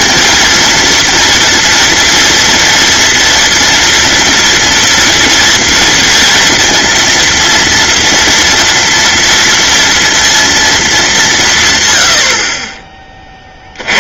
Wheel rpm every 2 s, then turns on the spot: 230, 230, 230, 230, 230, 220, 30.
none